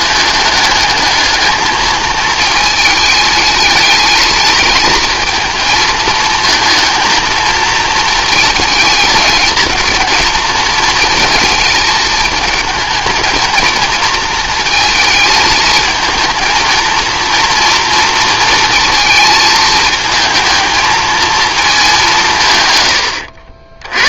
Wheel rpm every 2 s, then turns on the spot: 210, 220, 220, 230, 220, 220, 220, 230, 230, 220, 230, 110.
none